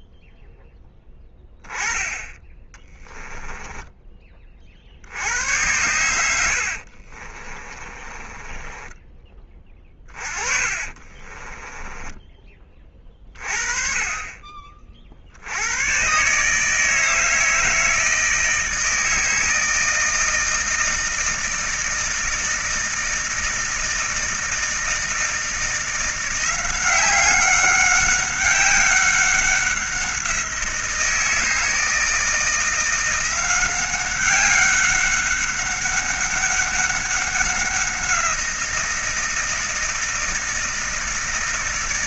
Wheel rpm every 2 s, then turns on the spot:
0, 10, 30, 70, 20, 30, 20, 30, 150, 160, 160, 160, 160, 180, 200, 170, 170, 190, 200, 170, 160.
2-4 6-12